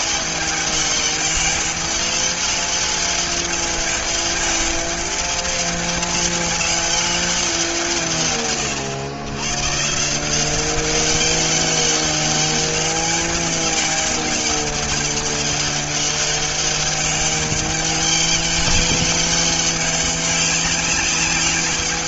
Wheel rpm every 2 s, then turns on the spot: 200, 200, 200, 200, 120, 180, 200, 200, 200, 200, 190.
none